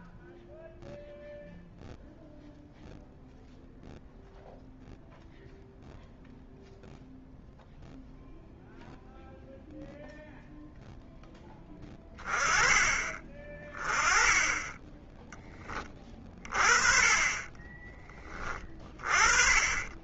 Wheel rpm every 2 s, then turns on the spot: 0, 0, 0, 0, 0, 0, 20, 10, 30, 30.
none